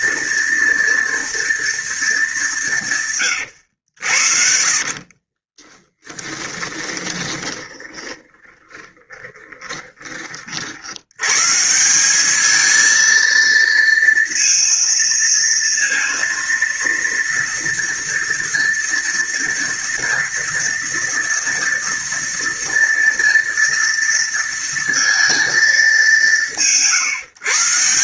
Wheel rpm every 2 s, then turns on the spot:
230, 180, 40, 10, 20, 60, 220, 230, 230, 230, 230, 230, 230, 150.
6-10